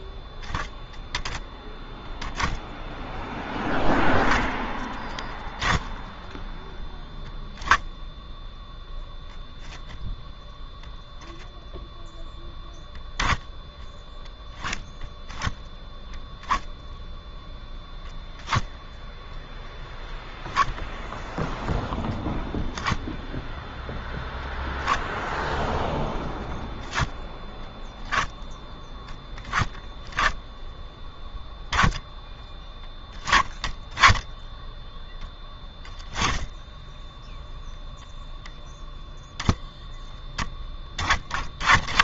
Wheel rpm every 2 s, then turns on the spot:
0, 0, 10, 0, 10, 0, 10, 10, 0, 0, 0, 10, 0, 10, 10, 10, 20, 10, 10, 10, 30.
none